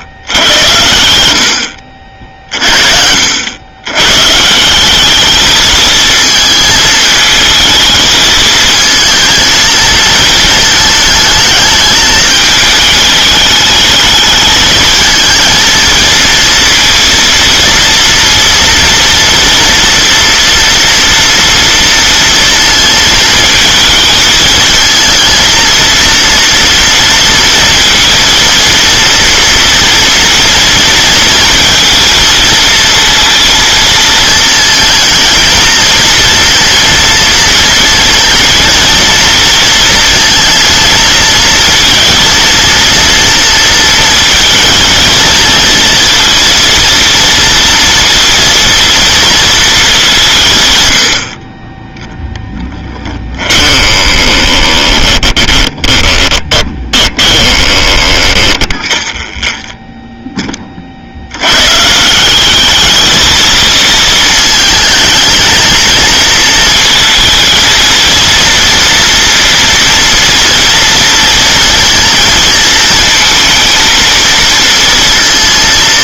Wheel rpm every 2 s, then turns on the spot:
90, 40, 160, 220, 220, 220, 220, 220, 230, 230, 230, 230, 220, 230, 230, 230, 220, 230, 230, 230, 230, 230, 230, 230, 230, 120, 10, 10, 20, 20, 30, 200, 220, 220, 230, 230, 230, 220.
52-60